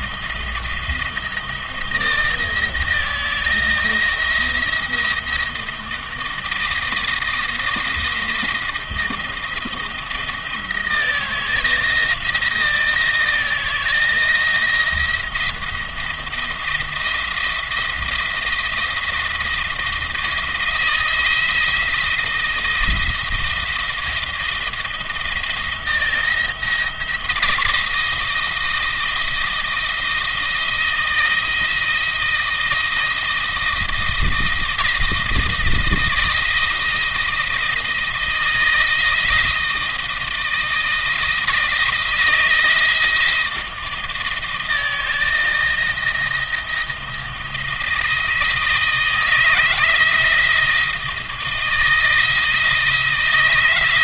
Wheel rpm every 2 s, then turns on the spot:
170, 160, 170, 160, 170, 170, 160, 170, 170, 170, 160, 170, 170, 170, 160, 160, 160, 160, 160, 160, 160, 160, 160, 160, 160, 160, 160.
none